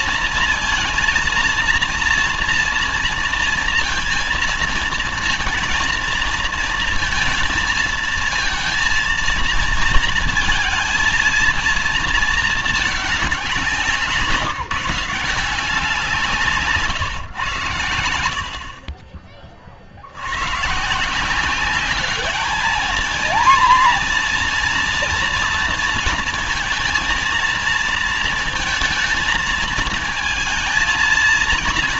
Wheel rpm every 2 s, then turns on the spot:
230, 230, 220, 230, 230, 230, 220, 160, 150, 60, 120, 210, 230, 230, 230, 220.
none